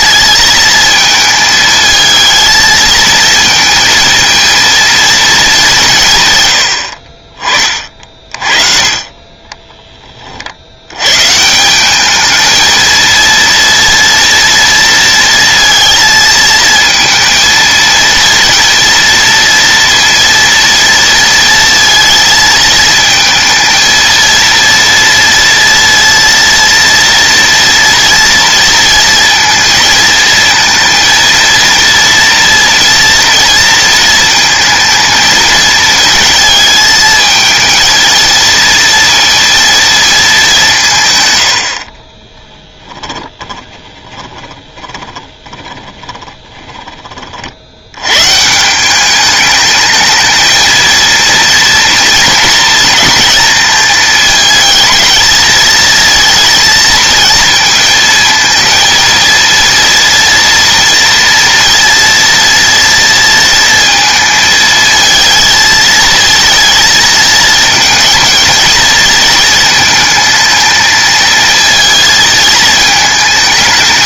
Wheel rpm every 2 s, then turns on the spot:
220, 220, 230, 60, 30, 70, 220, 230, 230, 230, 230, 230, 230, 230, 230, 230, 230, 220, 220, 230, 170, 30, 20, 30, 170, 230, 230, 220, 230, 230, 240, 230, 220, 220, 220, 220, 220.
42-48